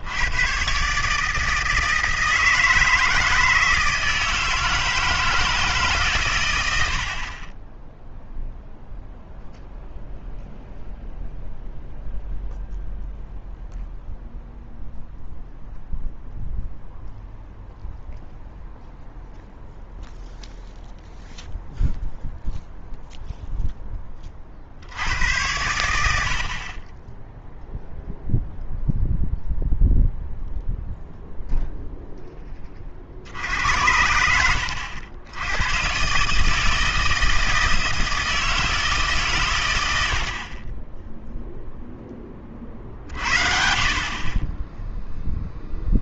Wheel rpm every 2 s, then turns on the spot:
130, 160, 160, 100, 0, 0, 0, 0, 0, 0, 0, 0, 60, 40, 0, 0, 30, 90, 160, 160, 20, 40, 10.
none